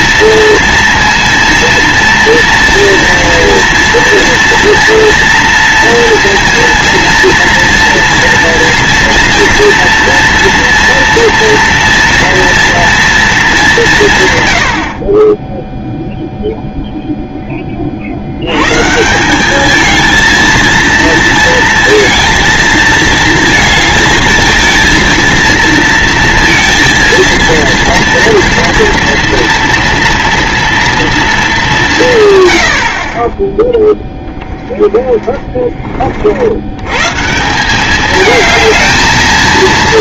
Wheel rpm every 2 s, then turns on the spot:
230, 230, 230, 230, 230, 240, 230, 80, 0, 130, 230, 230, 230, 230, 230, 240, 80, 20, 110, 220.
32-36